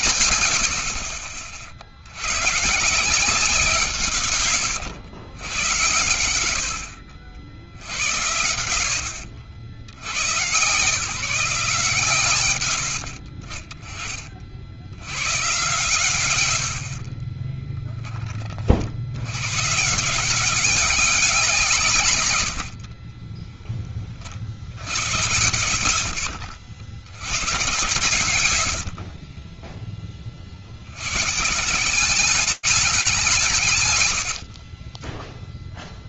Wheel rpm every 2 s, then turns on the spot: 100, 120, 120, 100, 90, 130, 80, 70, 80, 40, 180, 100, 70, 80, 70, 70, 200, 50.
28-30 34-36